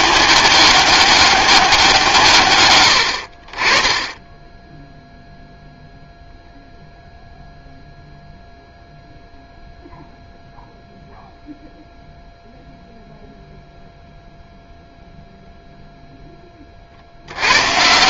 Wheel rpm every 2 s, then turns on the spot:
200, 90, 0, 0, 0, 0, 0, 0, 40.
none